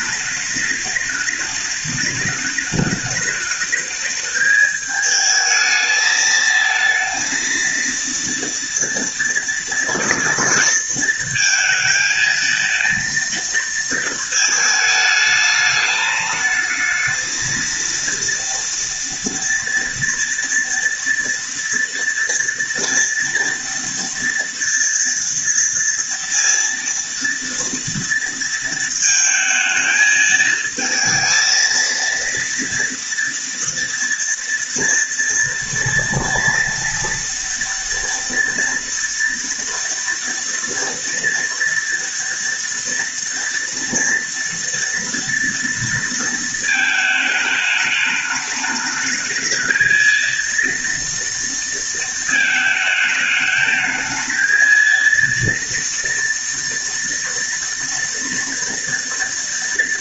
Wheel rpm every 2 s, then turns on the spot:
210, 210, 220, 230, 230, 230, 230, 220, 220, 230, 230, 230, 230, 230, 220, 230, 230, 230, 230, 230, 230, 230, 230, 220, 210, 230, 220, 230, 240, 230.
none